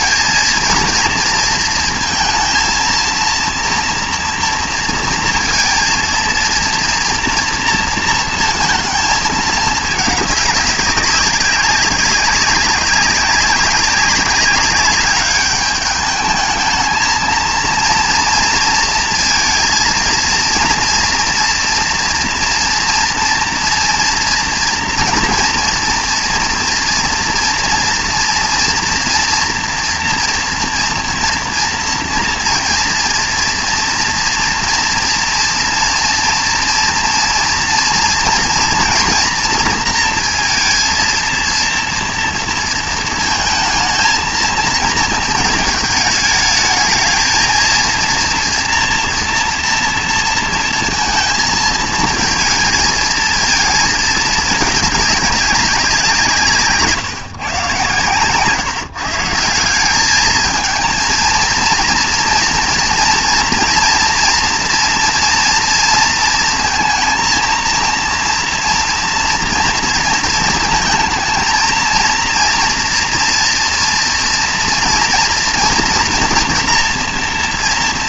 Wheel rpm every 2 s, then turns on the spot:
220, 230, 230, 230, 230, 200, 200, 200, 220, 230, 230, 230, 240, 240, 230, 240, 230, 230, 230, 230, 230, 230, 230, 220, 240, 230, 220, 210, 160, 150, 220, 230, 230, 230, 230, 220, 230, 230, 230.
none